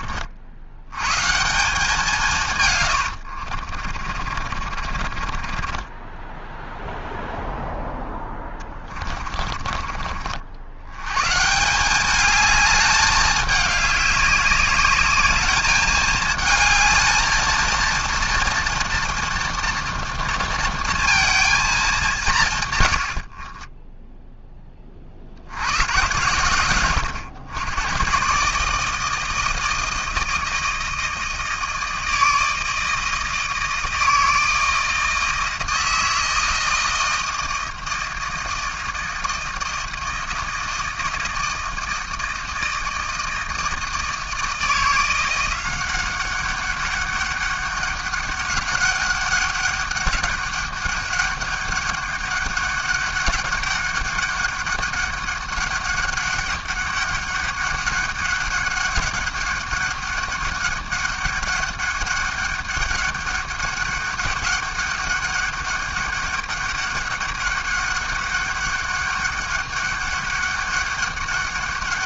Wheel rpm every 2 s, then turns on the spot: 80, 130, 50, 0, 20, 70, 210, 200, 220, 230, 230, 140, 20, 110, 150, 160, 160, 160, 160, 160, 160, 160, 170, 190, 200, 200, 200, 200, 200, 190, 200, 200, 200, 200, 200, 200.
2-6 8-10